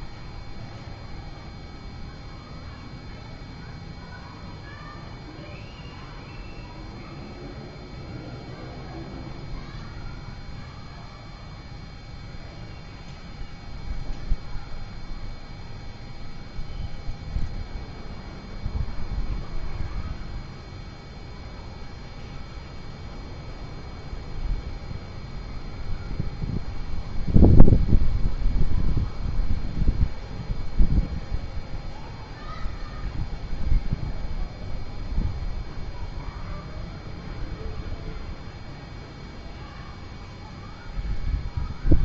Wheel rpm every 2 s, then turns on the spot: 0, 0, 0, 0, 0, 0, 0, 0, 0, 0, 0, 0, 0, 0, 0, 0, 0, 0, 0, 0, 0.
none